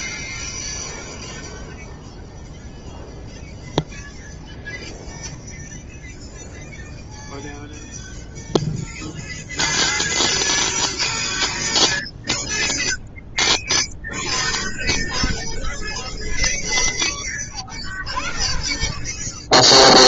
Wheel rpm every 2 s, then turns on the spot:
0, 0, 0, 0, 0, 0, 0, 0, 10, 10.
none